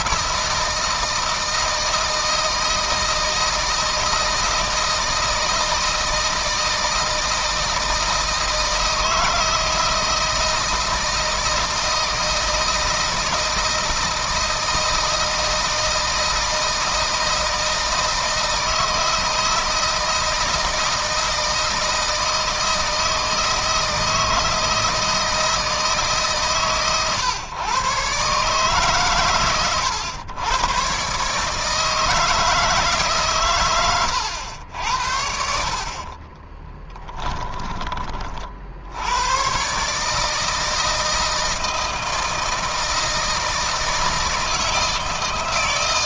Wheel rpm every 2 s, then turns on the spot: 160, 160, 160, 160, 160, 160, 160, 160, 160, 160, 160, 160, 160, 130, 130, 120, 150, 90, 20, 60, 160, 160, 160.
36-38